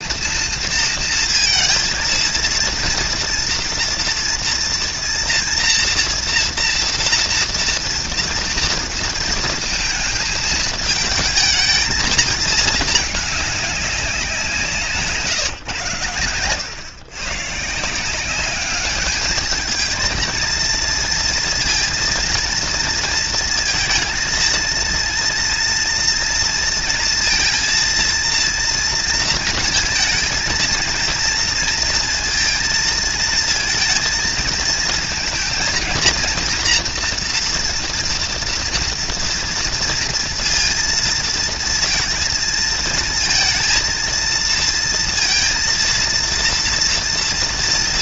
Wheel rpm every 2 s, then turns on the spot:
230, 230, 230, 230, 230, 220, 210, 160, 110, 210, 230, 230, 230, 240, 230, 230, 230, 220, 240, 230, 230, 220, 230, 230.
none